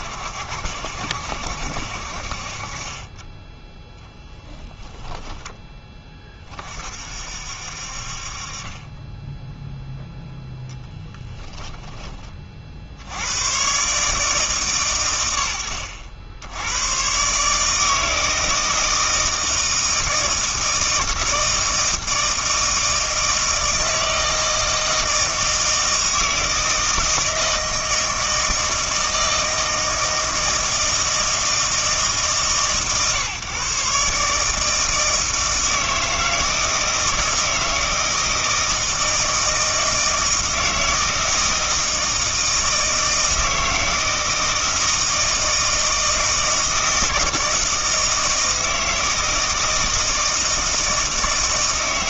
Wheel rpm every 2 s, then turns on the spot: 70, 30, 10, 40, 30, 10, 60, 140, 100, 160, 160, 160, 160, 160, 160, 160, 140, 160, 160, 160, 160, 160, 160, 160, 160, 160.
none